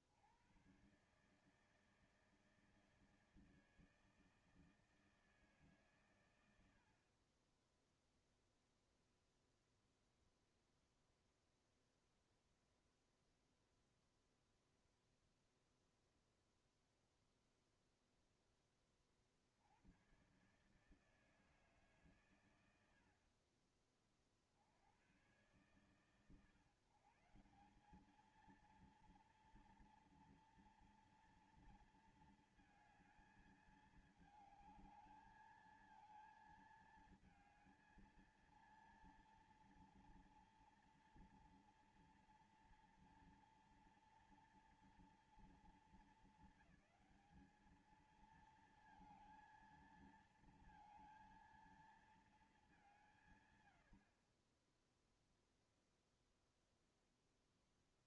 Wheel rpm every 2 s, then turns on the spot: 80, 160, 160, 110, 0, 0, 0, 0, 0, 10, 120, 120, 40, 130, 210, 230, 230, 220, 220, 230, 230, 240, 240, 220, 220, 230, 220, 50, 0.
none